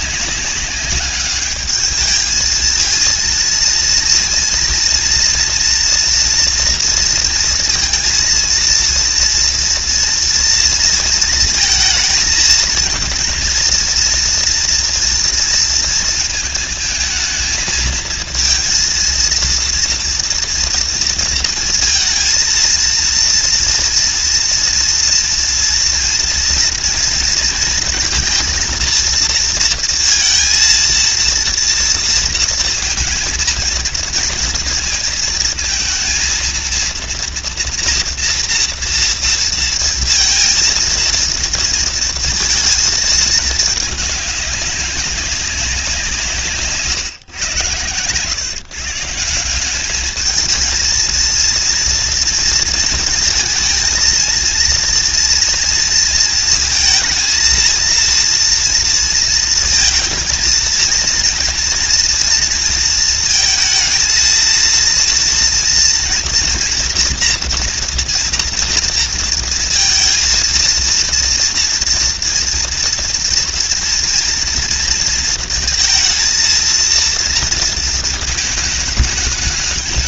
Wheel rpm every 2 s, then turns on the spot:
200, 230, 230, 230, 230, 230, 230, 230, 220, 230, 230, 230, 230, 230, 230, 230, 230, 230, 230, 230, 230, 220, 190, 130, 160, 230, 230, 230, 230, 230, 230, 220, 230, 240, 230, 230, 230, 230, 230, 210.
none